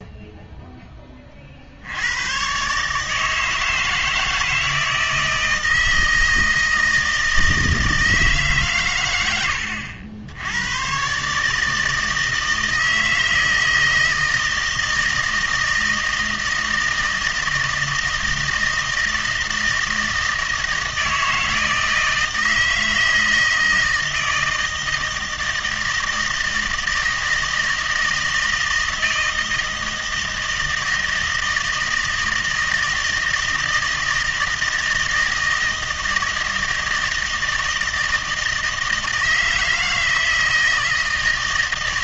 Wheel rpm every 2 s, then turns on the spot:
0, 130, 160, 160, 140, 100, 160, 160, 160, 160, 160, 160, 160, 160, 160, 160, 160, 160, 160, 160, 160.
none